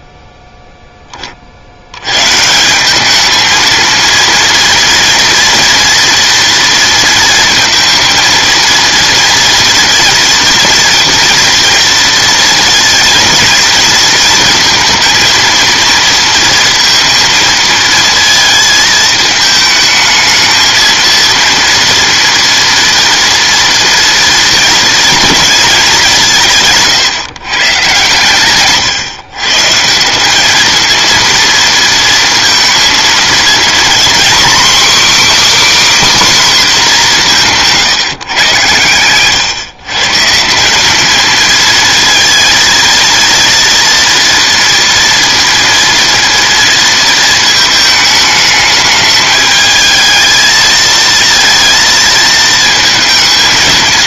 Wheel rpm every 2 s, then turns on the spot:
10, 180, 230, 230, 230, 240, 230, 230, 230, 220, 220, 230, 230, 150, 130, 220, 230, 270, 240, 110, 190, 230, 230, 230, 210, 230, 230.
none